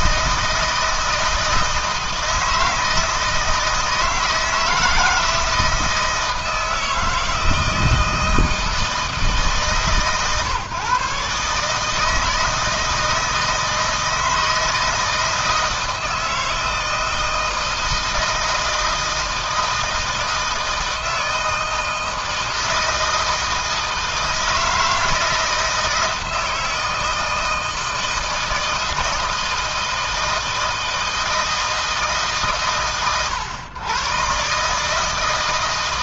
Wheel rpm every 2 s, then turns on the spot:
160, 160, 160, 160, 160, 150, 160, 160, 160, 160, 160, 160, 160, 160, 160, 160, 130, 150.
none